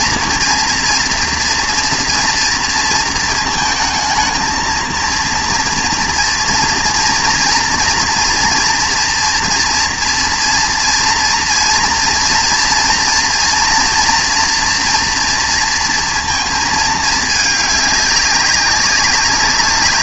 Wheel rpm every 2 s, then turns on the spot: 230, 230, 220, 230, 230, 230, 230, 230, 220, 200.
none